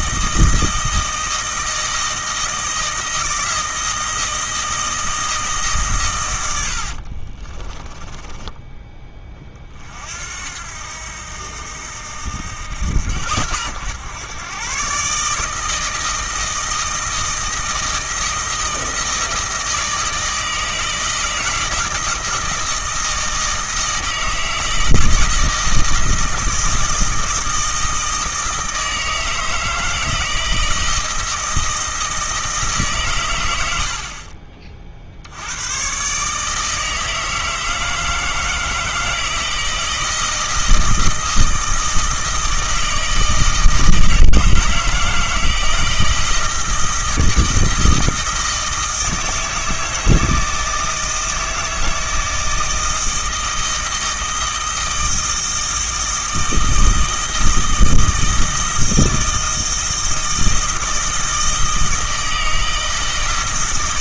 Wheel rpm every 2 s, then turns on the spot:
160, 160, 160, 70, 20, 80, 90, 130, 160, 160, 160, 160, 160, 160, 160, 160, 150, 50, 160, 160, 160, 160, 160, 160, 160, 160, 160, 160, 160, 160, 160, 160.
6-10